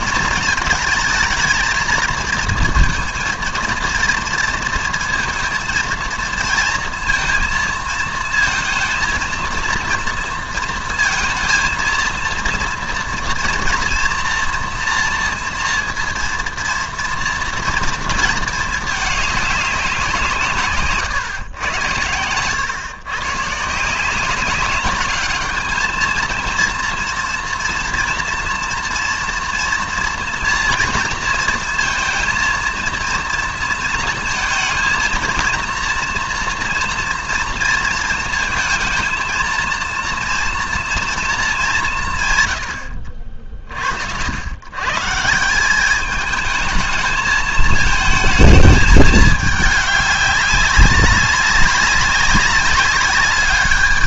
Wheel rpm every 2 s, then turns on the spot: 220, 230, 230, 230, 220, 230, 230, 230, 230, 220, 150, 120, 200, 230, 240, 230, 230, 230, 230, 230, 230, 110, 120, 220, 220, 200, 190.
none